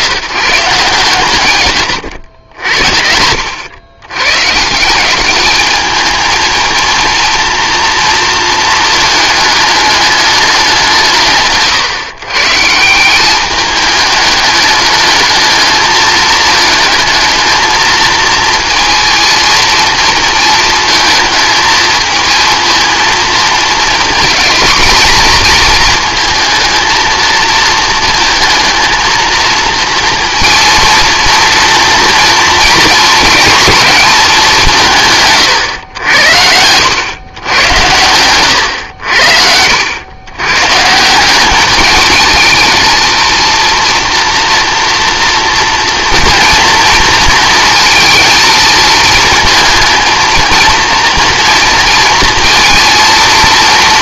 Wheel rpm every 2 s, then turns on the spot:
160, 80, 150, 230, 220, 200, 150, 210, 220, 230, 230, 230, 230, 220, 230, 230, 230, 180, 90, 110, 120, 220, 240, 230, 220, 230, 230.
none